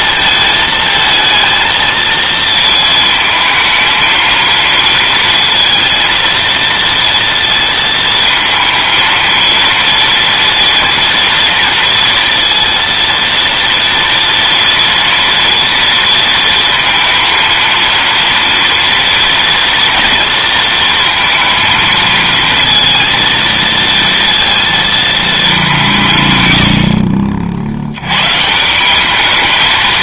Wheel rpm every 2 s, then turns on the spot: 220, 230, 230, 230, 230, 230, 230, 230, 230, 230, 230, 230, 230, 90, 160.
none